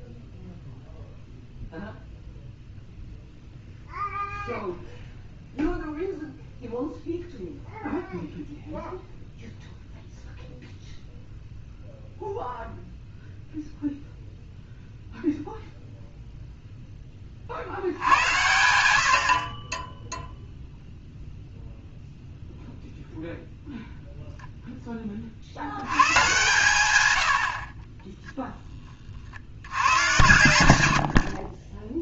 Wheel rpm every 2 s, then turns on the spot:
0, 0, 0, 0, 0, 0, 0, 0, 0, 100, 0, 0, 10, 140, 20, 100.
none